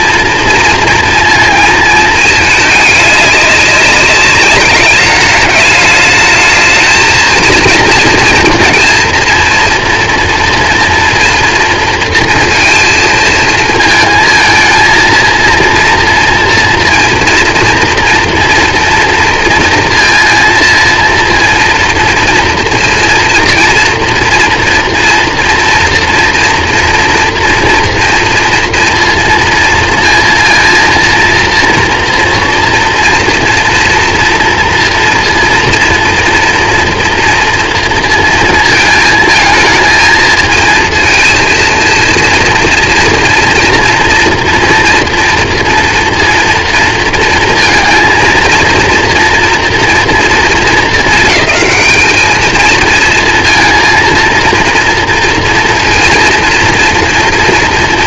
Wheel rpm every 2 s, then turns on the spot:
230, 220, 200, 220, 230, 230, 230, 220, 230, 230, 230, 230, 230, 240, 240, 230, 230, 230, 230, 230, 220, 230, 240, 230, 230, 230, 220, 230, 230.
none